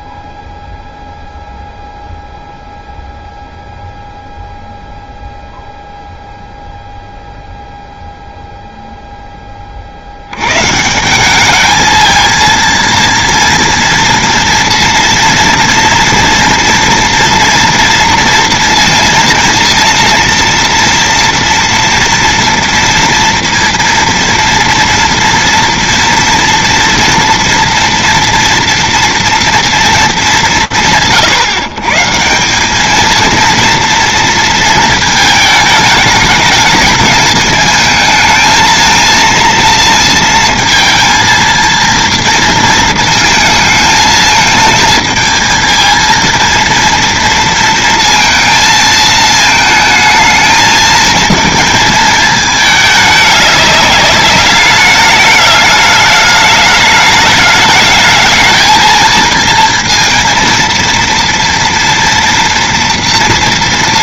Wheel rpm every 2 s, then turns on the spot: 0, 0, 0, 0, 0, 130, 230, 230, 240, 230, 230, 230, 230, 230, 230, 130, 210, 220, 210, 220, 230, 230, 220, 230, 220, 220, 210, 210, 210, 220, 230, 240.
none